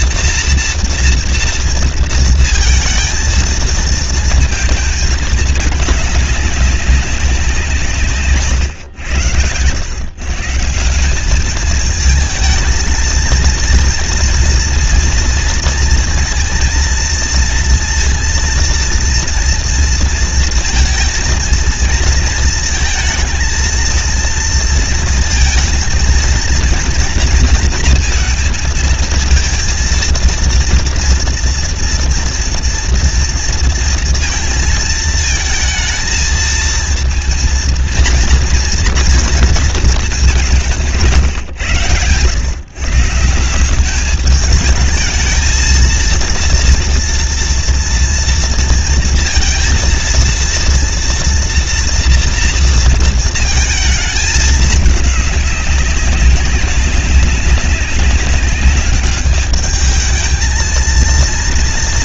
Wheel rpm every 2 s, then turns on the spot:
240, 230, 230, 200, 130, 150, 220, 240, 230, 230, 230, 220, 230, 230, 230, 230, 230, 230, 220, 230, 180, 120, 220, 230, 230, 230, 230, 210, 190, 200, 220.
none